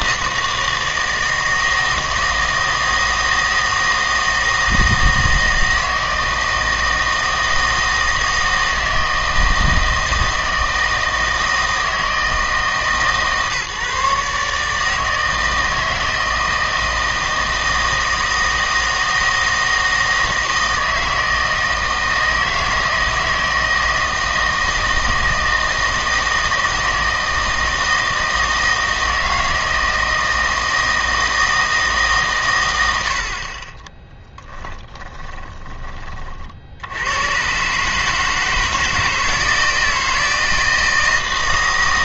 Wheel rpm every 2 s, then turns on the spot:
160, 160, 160, 160, 160, 160, 160, 150, 160, 160, 160, 160, 160, 160, 160, 160, 110, 10, 70, 160, 160.
34-36